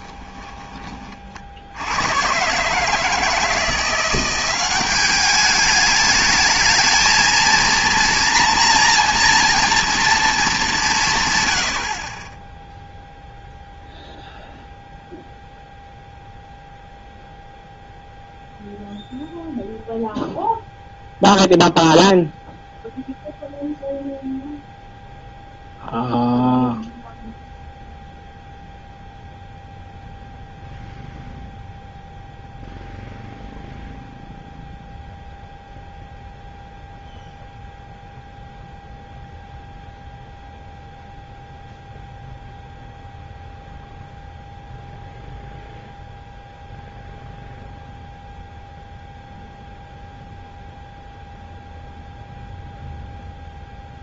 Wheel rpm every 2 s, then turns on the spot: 10, 130, 190, 220, 240, 200, 0, 0, 0, 0, 0, 0, 0, 0, 0, 0, 0, 0, 0, 0, 0, 0, 0, 0, 0, 0, 0.
none